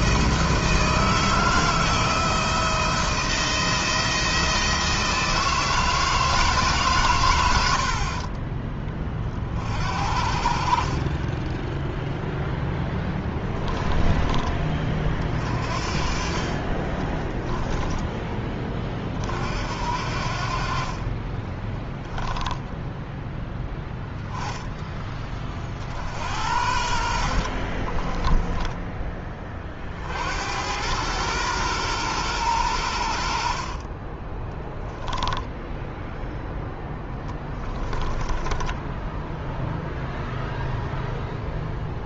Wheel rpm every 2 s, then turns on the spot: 160, 170, 160, 140, 30, 40, 10, 30, 30, 30, 40, 10, 10, 70, 20, 100, 80, 10, 10, 10, 0.
12-14 16-18 26-28 34-40